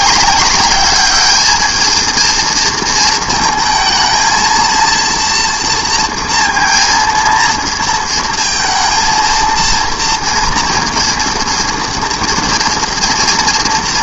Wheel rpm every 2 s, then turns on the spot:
200, 230, 230, 230, 230, 230, 230.
none